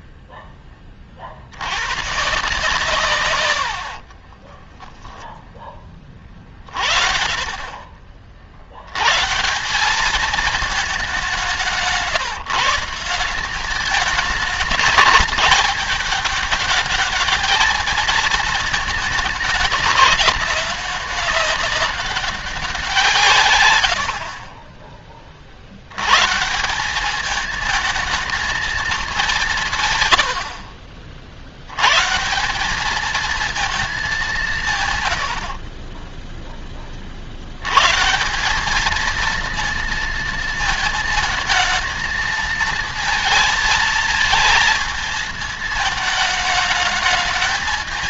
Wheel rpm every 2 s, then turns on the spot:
10, 140, 30, 40, 50, 210, 160, 210, 210, 220, 200, 200, 40, 150, 230, 80, 160, 190, 10, 180, 230, 220, 220, 220.
4-6 30-32